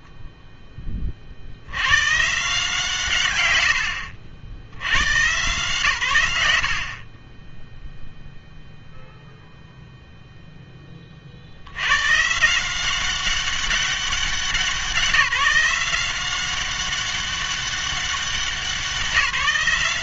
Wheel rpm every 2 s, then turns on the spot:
10, 150, 70, 80, 0, 10, 170, 180, 190, 170.
0-2